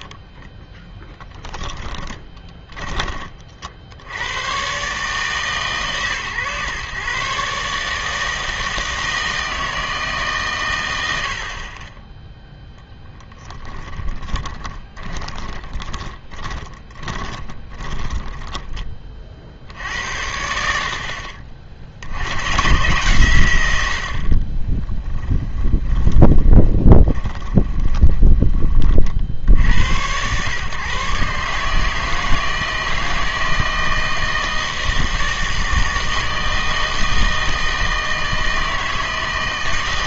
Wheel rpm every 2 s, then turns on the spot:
10, 20, 120, 130, 160, 130, 0, 20, 30, 10, 70, 120, 30, 30, 30, 130, 160, 160, 160, 160.
0-4 14-18 24-28